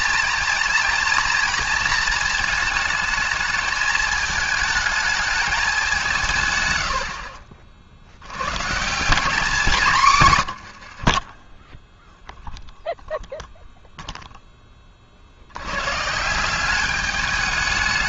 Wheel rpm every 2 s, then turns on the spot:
230, 220, 220, 110, 140, 110, 0, 20, 190.
6-8 10-12